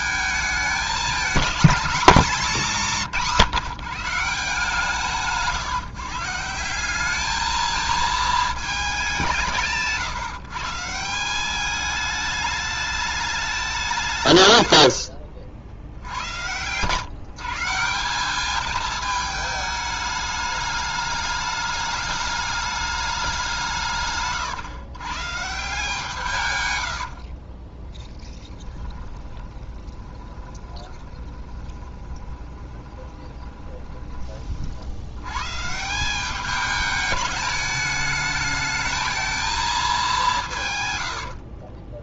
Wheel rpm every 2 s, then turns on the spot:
210, 200, 160, 190, 210, 150, 210, 90, 120, 210, 210, 210, 130, 100, 30, 20, 20, 50, 210, 220, 120.
2-4 14-16 26-34